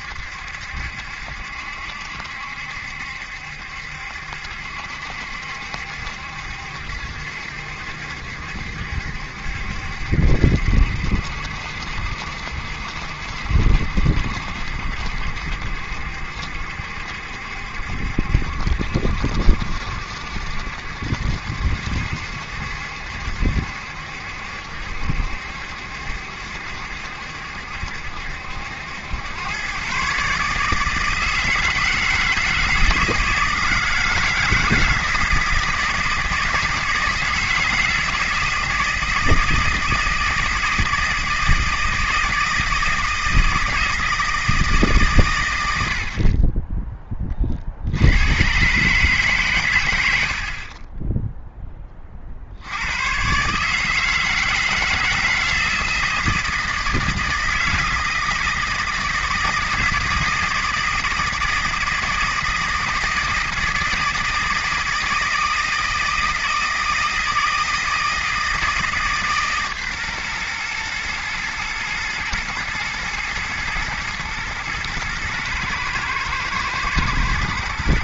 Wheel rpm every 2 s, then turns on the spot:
70, 70, 70, 70, 70, 70, 60, 60, 70, 70, 70, 70, 70, 70, 90, 160, 160, 160, 160, 160, 160, 160, 150, 20, 140, 30, 90, 160, 160, 160, 160, 160, 160, 160, 160, 120, 110, 110, 110.
none